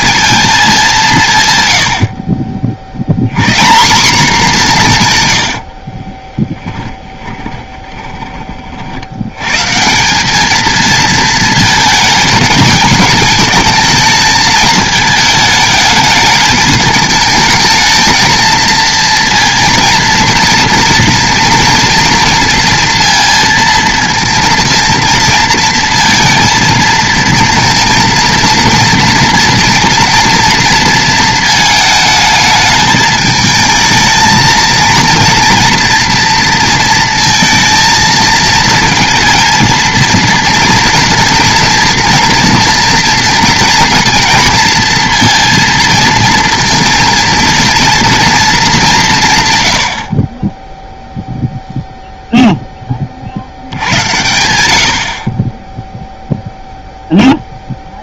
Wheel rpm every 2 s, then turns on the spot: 170, 70, 160, 10, 60, 220, 220, 220, 220, 230, 230, 230, 230, 230, 230, 230, 220, 230, 220, 220, 230, 230, 230, 230, 190, 0, 20, 70, 0.
6-8